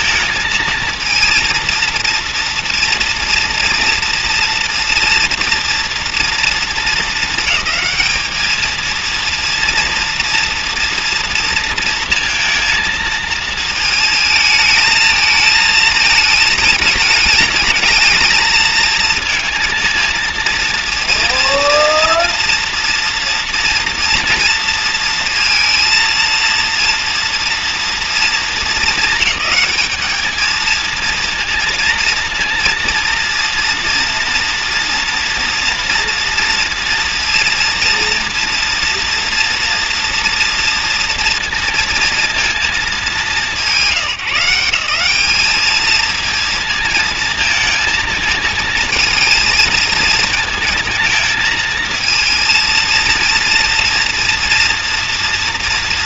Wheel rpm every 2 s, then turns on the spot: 230, 230, 230, 230, 220, 230, 230, 220, 220, 220, 230, 230, 230, 230, 220, 220, 230, 230, 230, 230, 230, 210, 160, 230, 220, 230, 230, 230.
none